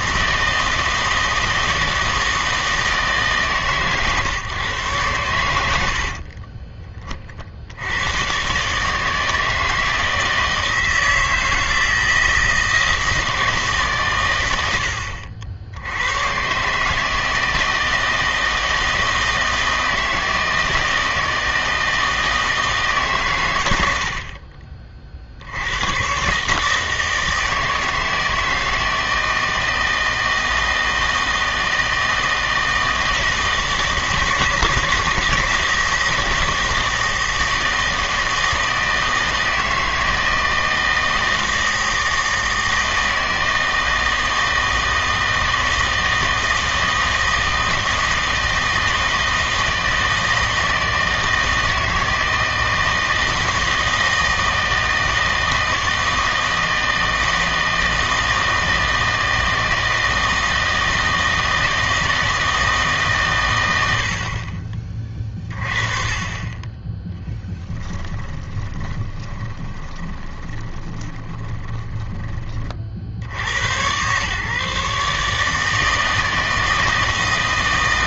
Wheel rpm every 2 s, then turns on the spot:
160, 160, 130, 30, 150, 160, 160, 80, 140, 160, 160, 160, 40, 150, 160, 160, 160, 160, 160, 160, 160, 160, 160, 160, 160, 160, 160, 160, 160, 160, 160, 160, 40, 10, 20, 20, 50, 140, 160.
68-72